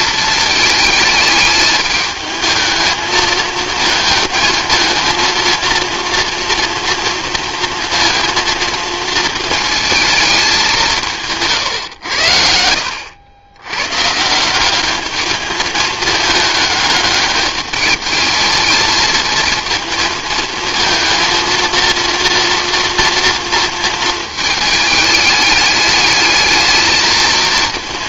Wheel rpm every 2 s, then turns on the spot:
220, 220, 220, 230, 230, 200, 80, 190, 210, 220, 230, 240, 220, 210.
none